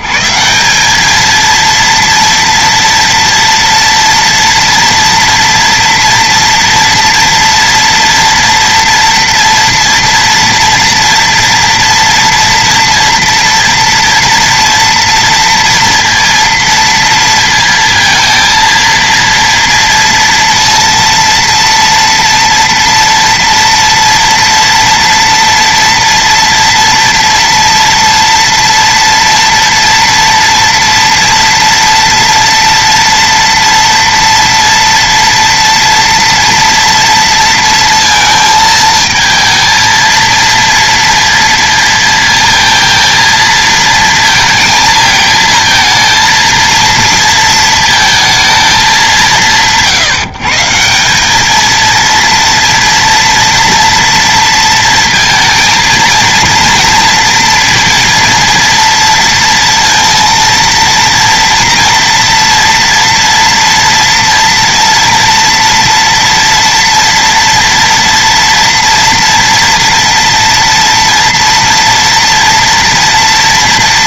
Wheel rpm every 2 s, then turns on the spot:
180, 230, 230, 230, 230, 230, 230, 230, 230, 230, 230, 230, 230, 230, 230, 230, 230, 230, 230, 220, 230, 230, 230, 230, 220, 170, 230, 230, 230, 230, 230, 240, 230, 230, 230, 230, 230.
none